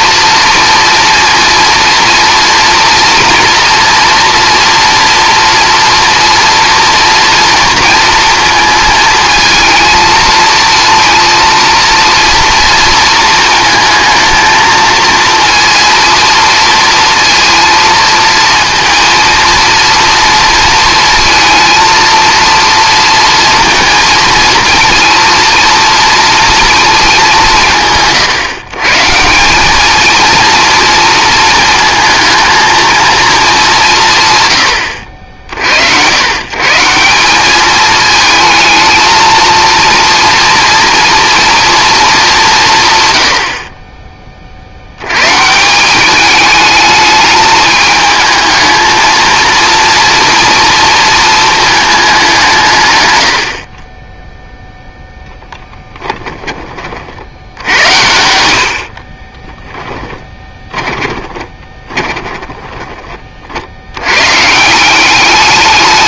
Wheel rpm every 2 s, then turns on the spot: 230, 230, 230, 230, 230, 230, 230, 220, 230, 230, 230, 230, 230, 230, 140, 230, 230, 110, 140, 220, 230, 170, 50, 210, 220, 230, 170, 0, 30, 70, 20, 20, 160.
60-64